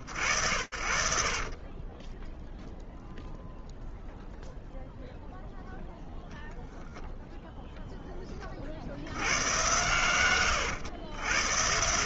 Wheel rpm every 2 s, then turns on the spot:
70, 0, 0, 0, 100, 120.
none